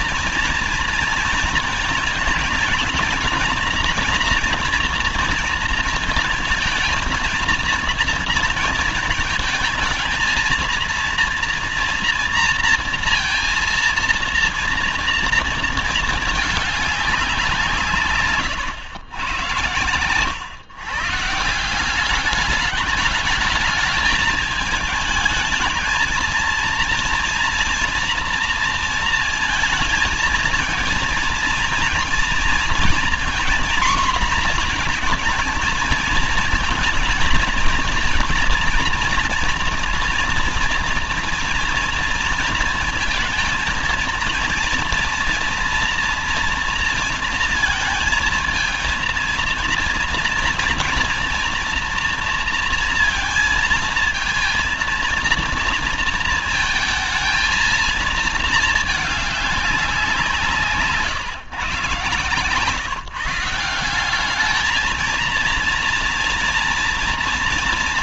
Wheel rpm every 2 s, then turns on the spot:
230, 230, 230, 230, 230, 230, 230, 230, 210, 130, 130, 210, 220, 230, 230, 230, 230, 240, 220, 230, 240, 230, 230, 230, 220, 230, 230, 230, 230, 220, 160, 150, 210, 230.
none